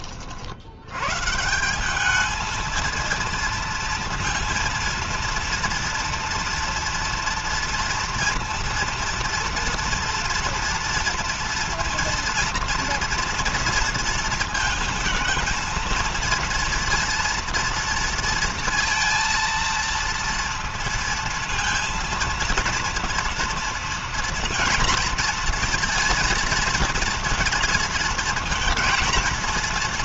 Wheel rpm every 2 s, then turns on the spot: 100, 230, 230, 230, 230, 230, 230, 230, 230, 230, 230, 230, 230, 230, 230.
none